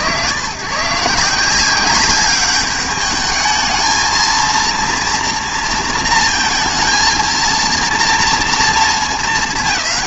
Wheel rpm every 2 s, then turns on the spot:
110, 200, 230, 230, 230.
none